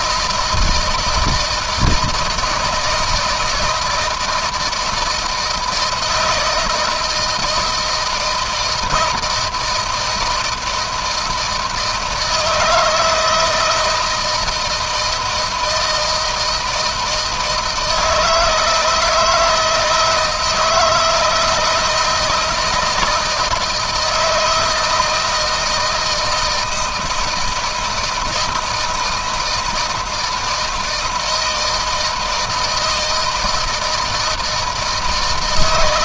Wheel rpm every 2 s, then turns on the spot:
160, 160, 170, 160, 160, 160, 160, 160, 160, 160, 160, 160, 160, 160, 160, 160, 160, 160.
none